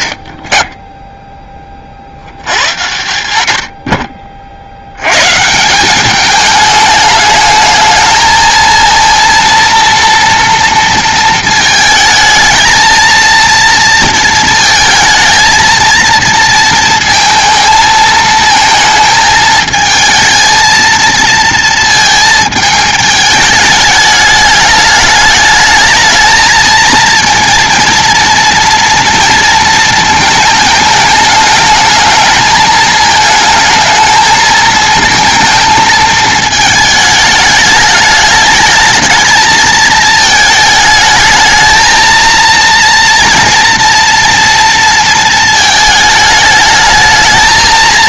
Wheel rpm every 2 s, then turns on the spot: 50, 60, 70, 210, 230, 230, 220, 230, 230, 220, 220, 220, 210, 220, 230, 220, 220, 220, 220, 210, 220, 230, 230, 210.
none